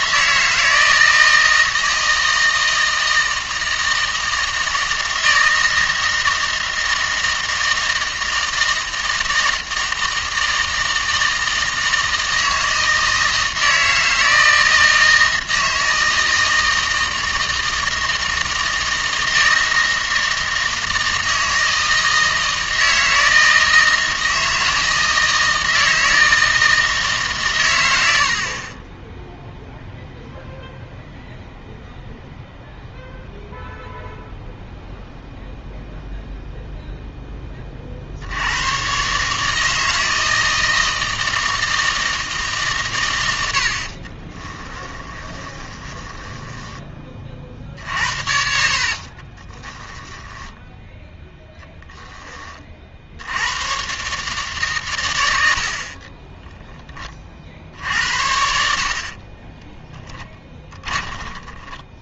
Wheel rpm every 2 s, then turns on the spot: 160, 160, 160, 160, 160, 160, 160, 160, 160, 160, 160, 160, 160, 160, 40, 0, 0, 0, 0, 100, 160, 140, 20, 10, 60, 10, 40, 130, 10, 70, 10.
44-52 60-62